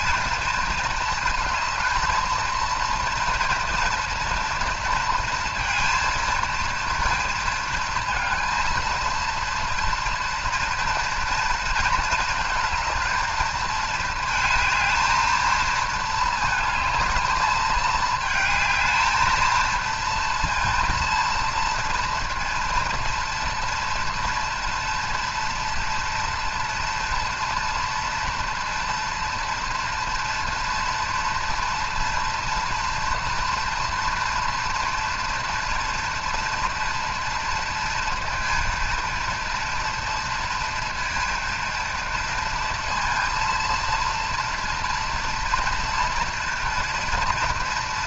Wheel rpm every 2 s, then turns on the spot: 220, 230, 230, 230, 230, 230, 220, 220, 220, 220, 230, 230, 230, 230, 230, 230, 230, 230, 230, 230, 230, 230, 230, 230.
none